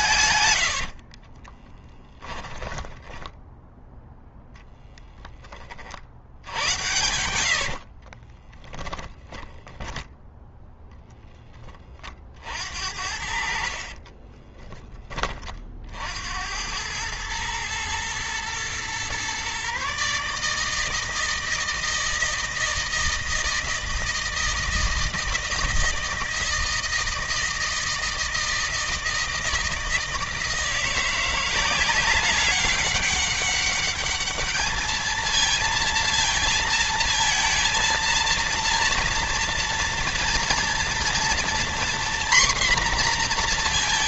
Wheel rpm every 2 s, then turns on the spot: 110, 10, 0, 80, 30, 0, 50, 20, 80, 120, 150, 160, 160, 160, 160, 160, 190, 220, 230, 230, 230, 250.
0-4 8-10 14-16